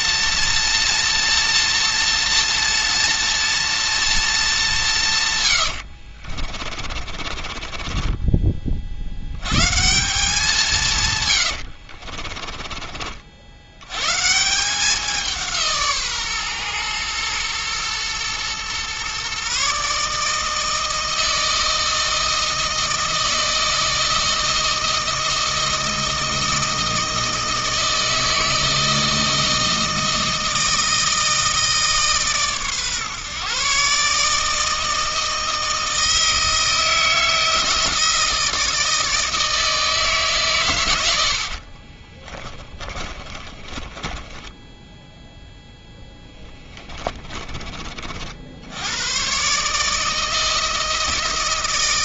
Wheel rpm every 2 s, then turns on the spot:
240, 230, 170, 40, 50, 160, 40, 180, 120, 130, 160, 160, 160, 160, 160, 160, 130, 160, 160, 160, 100, 20, 10, 20, 90, 150.
6-8 12-14 42-48